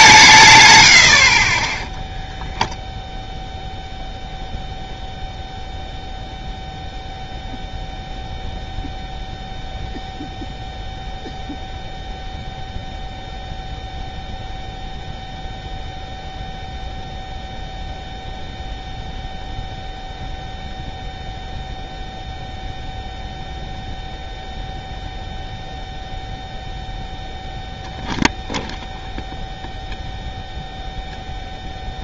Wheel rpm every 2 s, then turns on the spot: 110, 0, 0, 0, 0, 0, 0, 0, 0, 0, 0, 0, 0, 0, 0, 0.
none